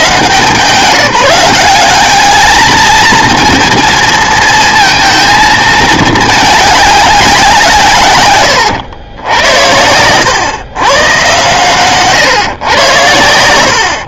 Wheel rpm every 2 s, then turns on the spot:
140, 210, 230, 210, 100, 130, 120.
none